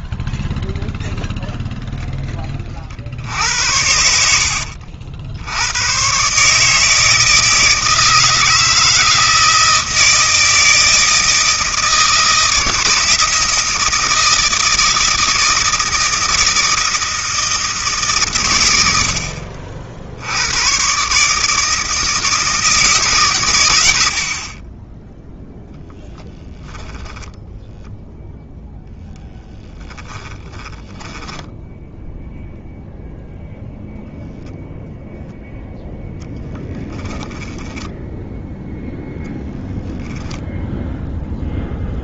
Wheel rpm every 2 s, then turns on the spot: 0, 20, 70, 150, 160, 160, 160, 160, 160, 110, 110, 160, 30, 10, 0, 20, 0, 0, 10, 0, 0.
30-32 36-38